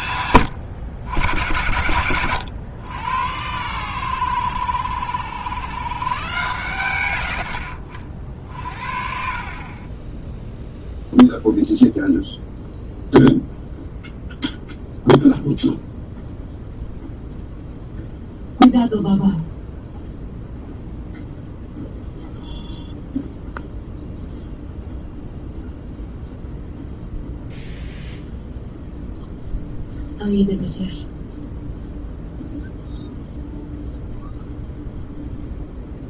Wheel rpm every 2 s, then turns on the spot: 110, 100, 90, 110, 50, 0, 0, 0, 0, 0, 0, 0, 0, 0, 0, 0, 0, 0.
none